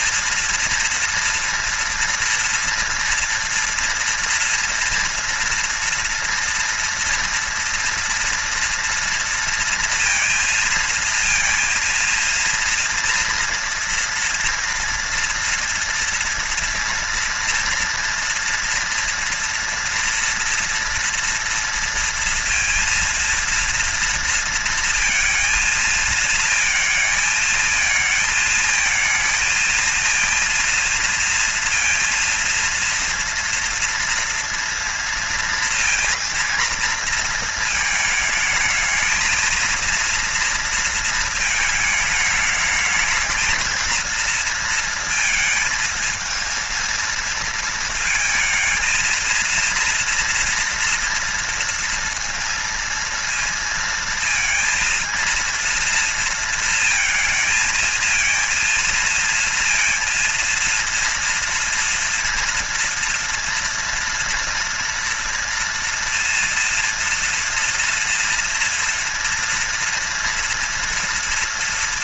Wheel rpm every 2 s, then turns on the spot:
230, 240, 230, 230, 230, 230, 230, 230, 230, 230, 230, 230, 230, 220, 220, 230, 230, 230, 230, 220, 230, 220, 230, 220, 230, 230, 230, 230, 220, 230, 230, 230, 230, 230, 230, 230.
none